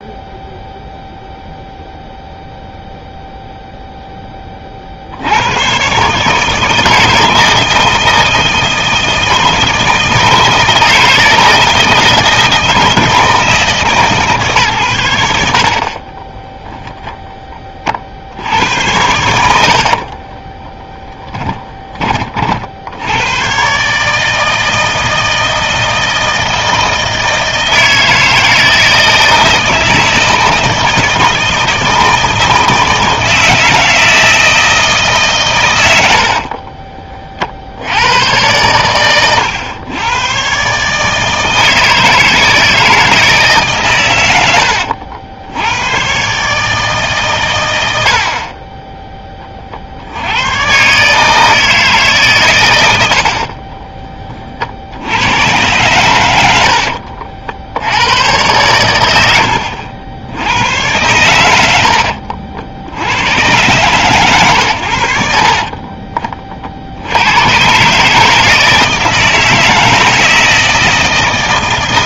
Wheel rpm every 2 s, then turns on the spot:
0, 0, 30, 150, 160, 160, 160, 130, 10, 90, 10, 60, 160, 160, 160, 160, 160, 160, 40, 110, 130, 160, 90, 150, 30, 110, 110, 50, 70, 100, 100, 70, 110, 40, 160, 160.
20-22 36-38 56-58